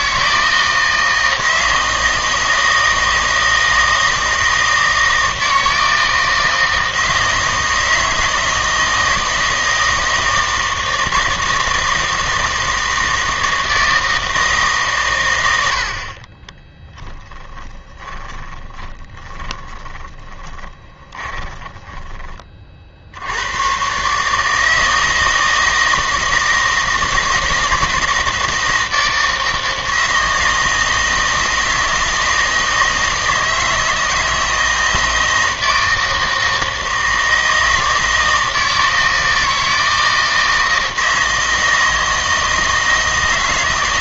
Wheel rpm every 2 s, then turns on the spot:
160, 160, 160, 160, 160, 160, 160, 150, 10, 10, 20, 30, 160, 160, 160, 160, 160, 160, 160, 160, 160, 160.
16-22